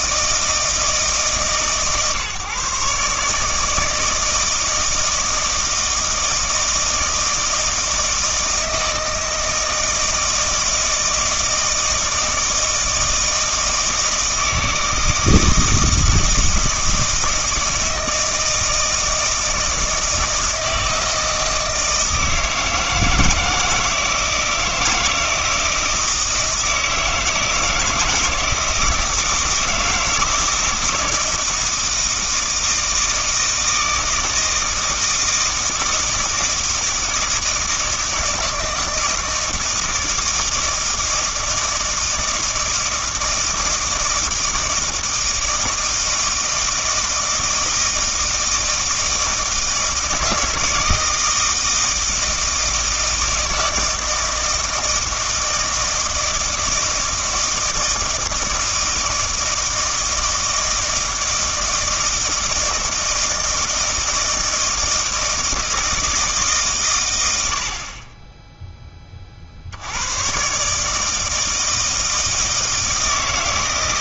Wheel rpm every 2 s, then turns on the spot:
160, 140, 160, 160, 160, 160, 160, 160, 160, 160, 160, 160, 170, 160, 160, 160, 160, 160, 160, 160, 160, 160, 160, 160, 160, 170, 160, 160, 160, 160, 160, 160, 160, 140, 10, 150, 160.
none